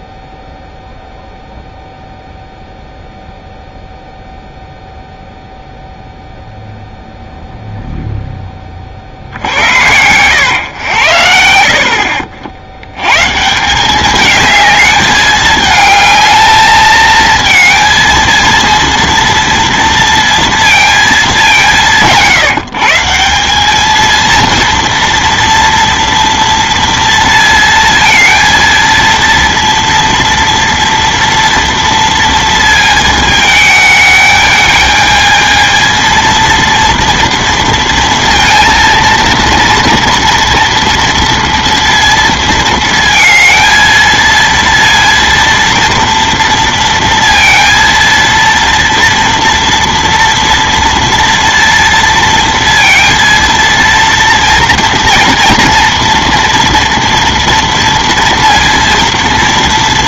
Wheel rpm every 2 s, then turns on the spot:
0, 0, 0, 0, 20, 100, 70, 210, 220, 230, 230, 150, 230, 230, 230, 230, 230, 220, 230, 230, 230, 230, 230, 230, 230, 230, 230, 230, 230, 230.
none